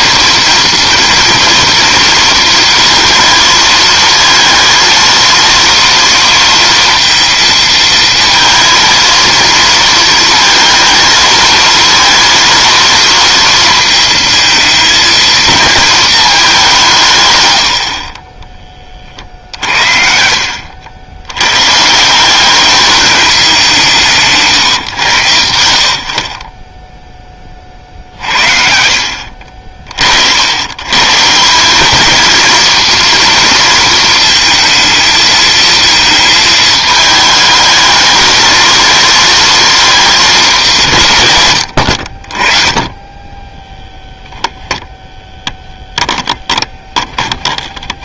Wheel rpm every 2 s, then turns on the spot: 230, 230, 230, 230, 230, 230, 230, 230, 190, 20, 70, 200, 130, 20, 60, 100, 230, 220, 220, 220, 180, 30, 10, 10.
44-48